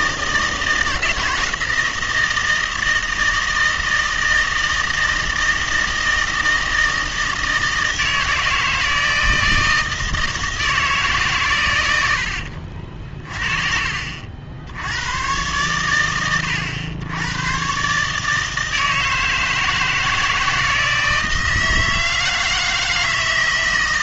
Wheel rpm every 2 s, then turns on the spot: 160, 160, 160, 160, 160, 160, 50, 70, 100, 160, 160, 160.
none